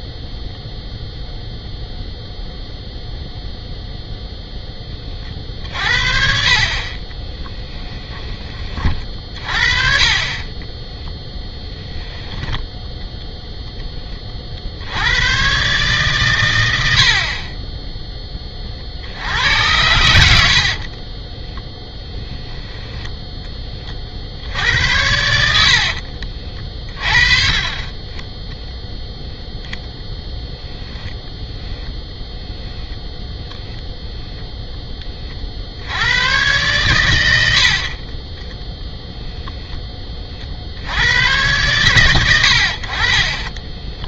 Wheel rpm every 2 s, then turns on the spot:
0, 0, 10, 30, 30, 20, 0, 60, 80, 40, 60, 10, 80, 30, 0, 0, 10, 10, 110, 0, 70, 60.
10-12 20-24